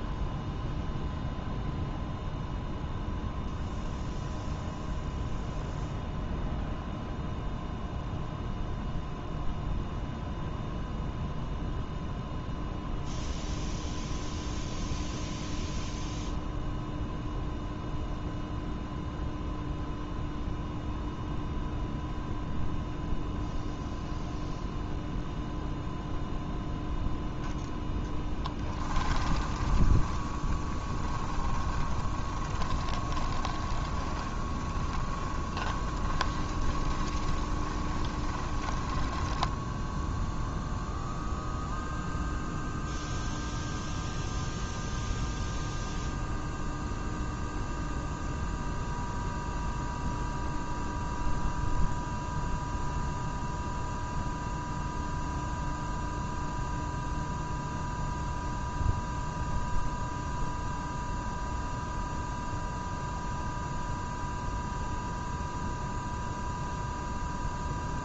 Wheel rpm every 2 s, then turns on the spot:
0, 0, 0, 0, 0, 0, 0, 0, 0, 0, 0, 0, 0, 0, 20, 20, 20, 20, 20, 10, 0, 0, 0, 0, 0, 0, 0, 0, 0, 0, 0, 0, 0, 0.
28-40